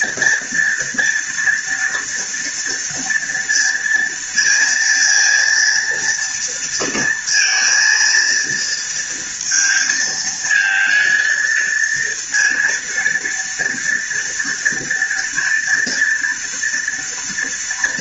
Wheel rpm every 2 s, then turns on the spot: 230, 230, 230, 230, 230, 230, 230, 230, 230.
none